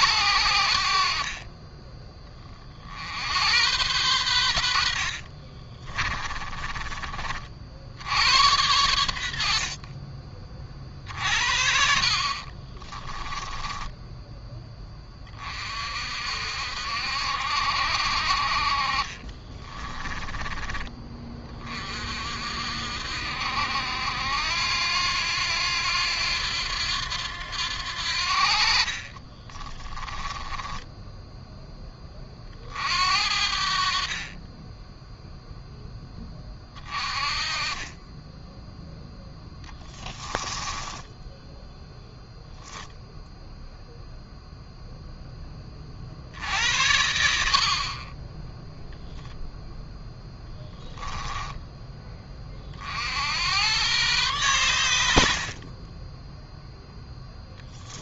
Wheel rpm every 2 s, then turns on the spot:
60, 60, 60, 30, 90, 40, 20, 20, 60, 40, 20, 60, 80, 90, 50, 20, 50, 10, 40, 0, 10, 0, 0, 80, 10, 10, 50, 100, 0.
4-6 12-14 18-20 28-32 40-42 50-52